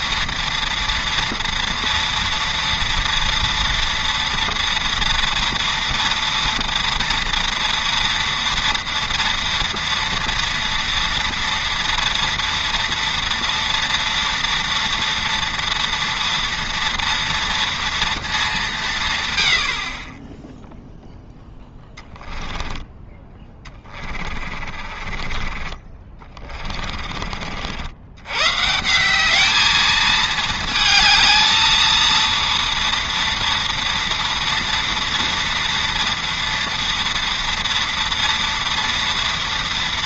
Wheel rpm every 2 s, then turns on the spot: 230, 230, 230, 230, 230, 230, 230, 230, 230, 190, 0, 10, 40, 30, 150, 220, 230, 230, 240, 240.
22-28